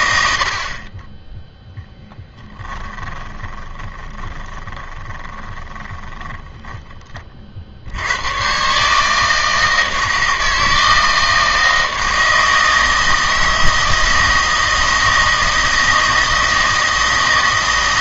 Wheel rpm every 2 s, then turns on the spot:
30, 10, 20, 10, 130, 160, 160, 160, 160.
2-6